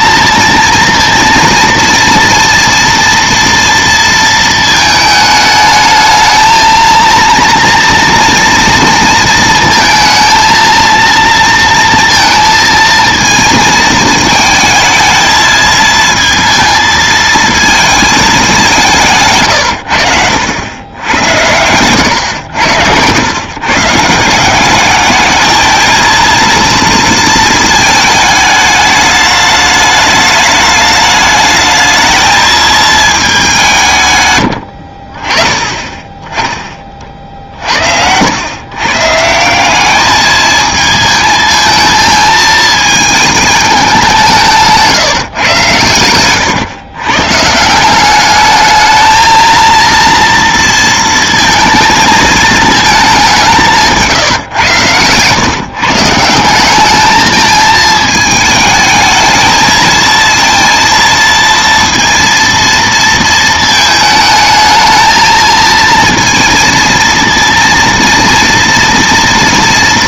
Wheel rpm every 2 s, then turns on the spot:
230, 230, 220, 220, 230, 230, 230, 220, 230, 200, 100, 90, 190, 230, 210, 210, 220, 80, 20, 110, 220, 220, 170, 120, 210, 230, 220, 120, 190, 220, 230, 230, 220, 230, 230.
none